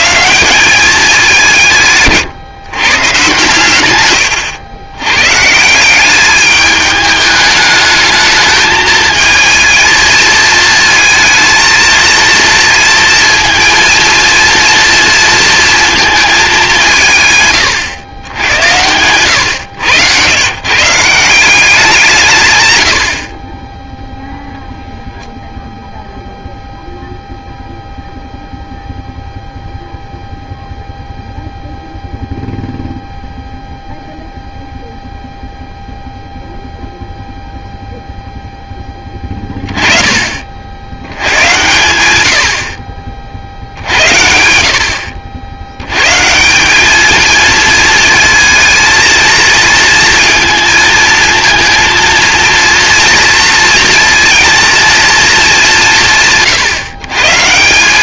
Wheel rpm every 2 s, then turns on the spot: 170, 140, 120, 210, 220, 220, 230, 230, 200, 100, 130, 130, 0, 0, 0, 0, 0, 0, 0, 20, 110, 50, 70, 220, 230, 220, 230, 220, 150.
none